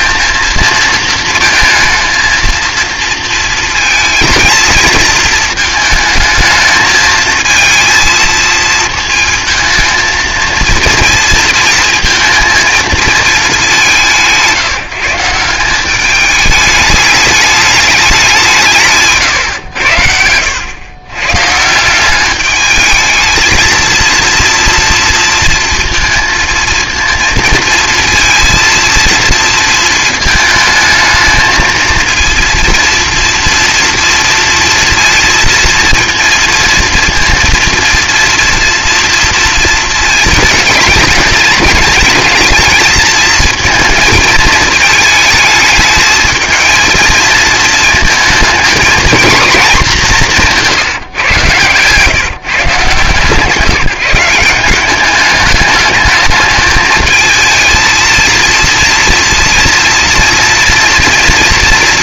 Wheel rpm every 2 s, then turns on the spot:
230, 230, 230, 220, 220, 230, 230, 170, 210, 190, 90, 200, 230, 230, 230, 220, 230, 230, 230, 230, 230, 220, 220, 220, 220, 180, 150, 170, 210, 230, 230.
none